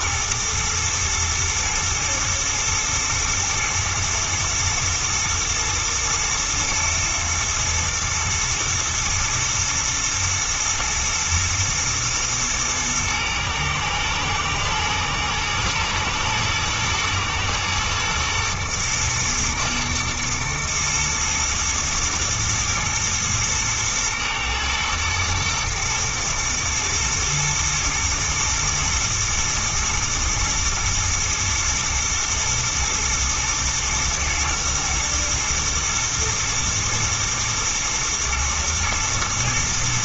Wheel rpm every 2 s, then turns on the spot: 120, 120, 110, 110, 110, 110, 120, 110, 120, 110, 110, 110, 110, 110, 110, 120, 120, 110, 120, 120.
none